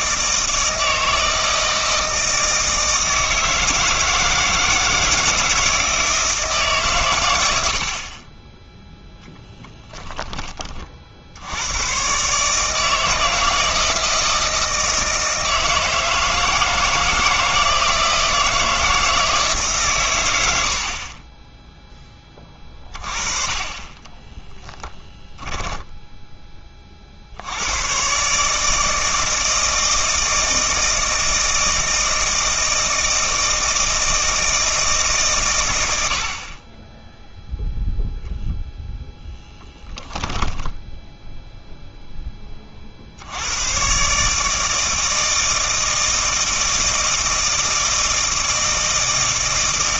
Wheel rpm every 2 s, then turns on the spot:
160, 160, 160, 140, 10, 30, 150, 160, 160, 160, 70, 40, 10, 30, 150, 160, 160, 160, 20, 0, 10, 40, 160, 160, 160.
24-26 40-42